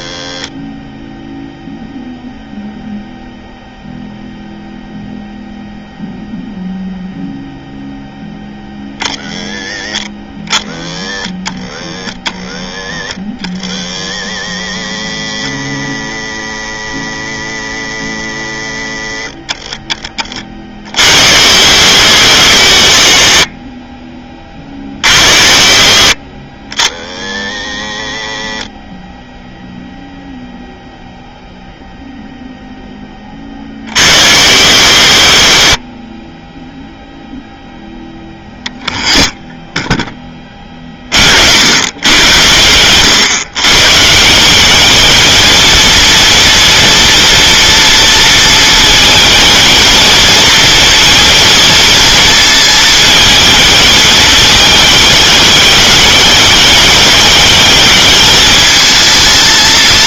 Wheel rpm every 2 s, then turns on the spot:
20, 0, 0, 0, 30, 60, 70, 110, 120, 70, 60, 70, 40, 70, 40, 0, 10, 80, 0, 0, 30, 110, 210, 240, 220, 230, 220, 210, 210, 220.
none